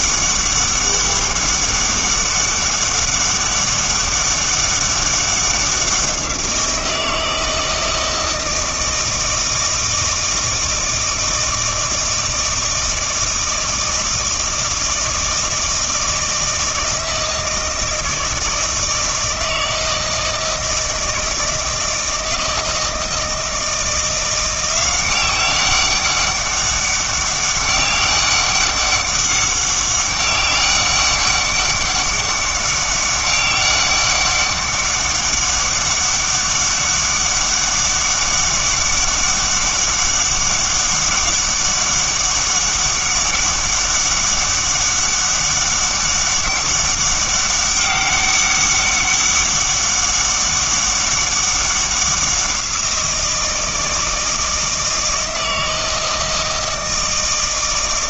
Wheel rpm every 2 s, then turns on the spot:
200, 200, 200, 170, 160, 160, 160, 160, 160, 160, 160, 160, 180, 200, 200, 200, 200, 200, 200, 200, 200, 200, 200, 200, 200, 200, 180, 160, 160.
none